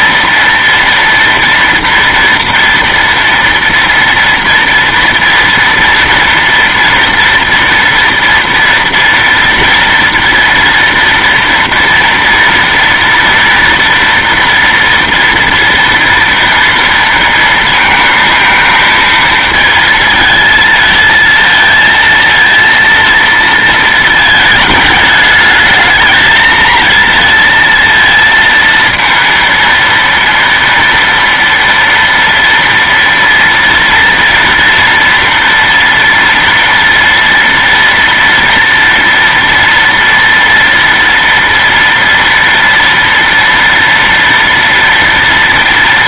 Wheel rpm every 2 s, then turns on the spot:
230, 230, 230, 240, 230, 230, 240, 230, 230, 220, 230, 230, 220, 230, 230, 230, 230, 230, 240, 240, 230, 230, 230.
none